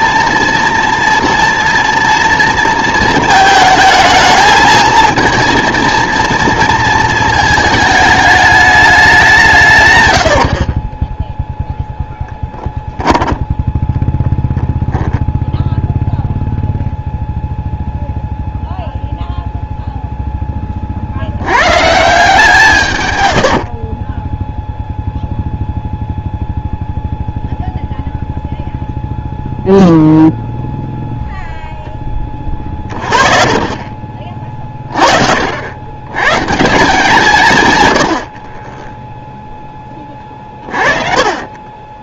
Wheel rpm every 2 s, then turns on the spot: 230, 230, 220, 230, 200, 30, 10, 10, 0, 0, 30, 130, 0, 0, 0, 0, 40, 40, 170, 10, 40.
10-12 40-42